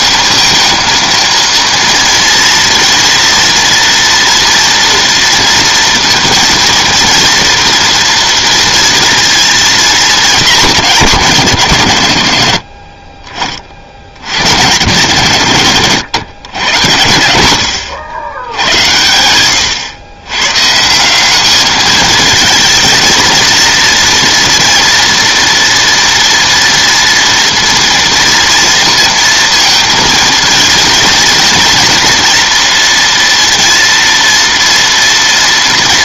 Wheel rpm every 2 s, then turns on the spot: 230, 230, 240, 230, 230, 210, 70, 100, 110, 90, 130, 220, 240, 230, 230, 230, 230, 230.
none